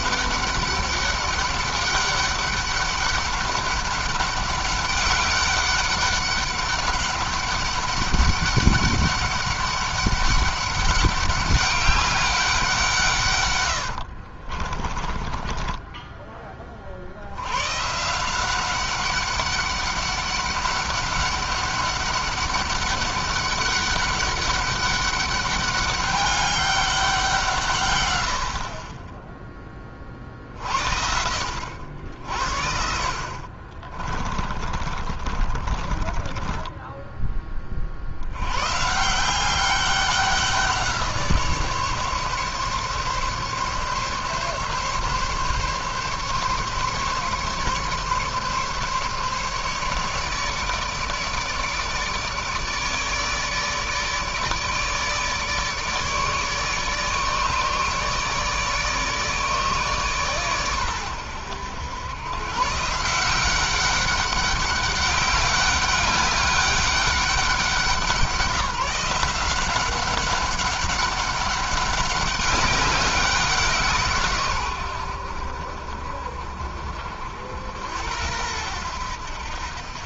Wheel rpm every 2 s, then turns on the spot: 200, 200, 200, 200, 200, 200, 160, 30, 40, 190, 200, 200, 200, 200, 40, 60, 50, 30, 20, 140, 180, 140, 140, 140, 140, 150, 150, 150, 150, 150, 120, 130, 200, 190, 160, 190, 200, 110, 60, 90.
14-16 34-38